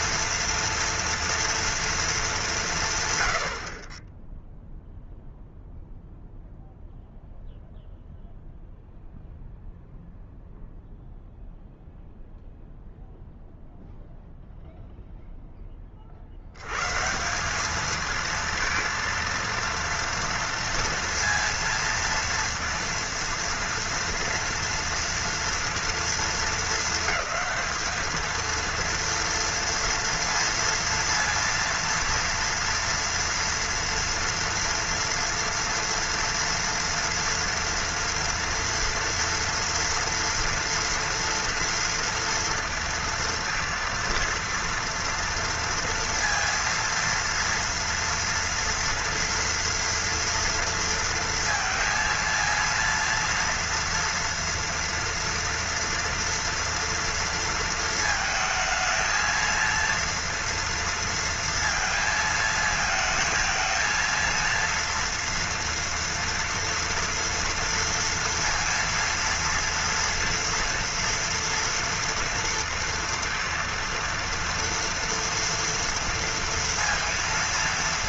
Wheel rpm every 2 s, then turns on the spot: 230, 180, 0, 0, 0, 0, 0, 0, 110, 230, 230, 230, 230, 220, 230, 230, 230, 230, 240, 230, 230, 230, 230, 230, 230, 230, 230, 230, 230, 220, 230, 220, 230, 230, 230, 230, 230, 230, 230.
none